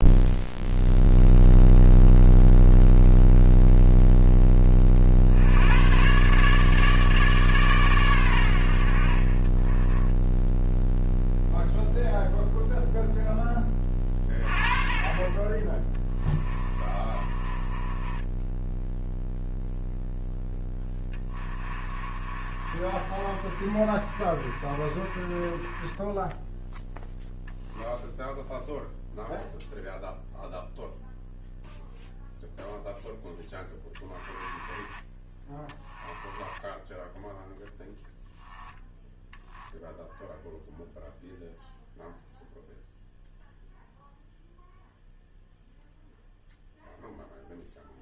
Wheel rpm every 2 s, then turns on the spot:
0, 0, 30, 150, 80, 0, 0, 30, 20, 10, 10, 30, 30, 0, 0, 0, 0, 10, 10, 0, 0, 0, 0, 0.
16-18 20-26 34-38